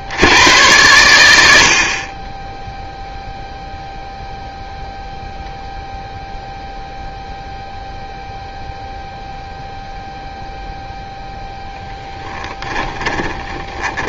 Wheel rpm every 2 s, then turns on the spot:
90, 0, 0, 0, 0, 0, 20.
12-14